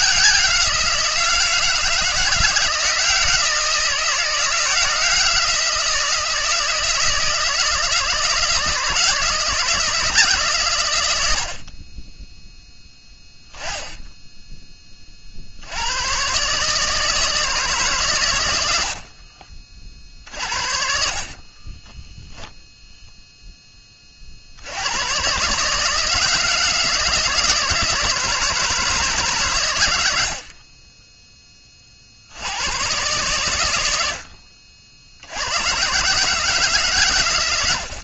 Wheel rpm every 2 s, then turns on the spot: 170, 170, 170, 160, 160, 80, 0, 20, 150, 90, 50, 0, 80, 160, 160, 30, 110, 60, 140.
18-20